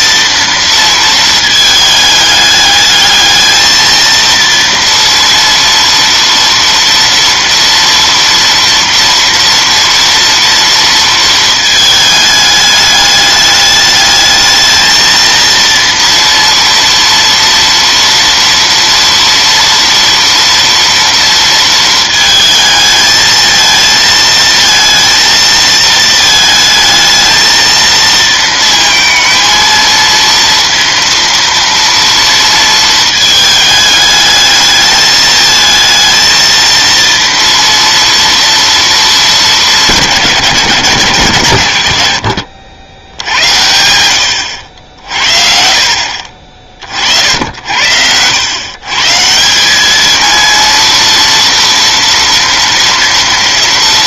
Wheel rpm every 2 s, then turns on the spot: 230, 210, 230, 230, 230, 230, 210, 220, 230, 230, 230, 220, 230, 220, 230, 230, 230, 210, 230, 230, 150, 90, 80, 50, 130, 230, 230.
none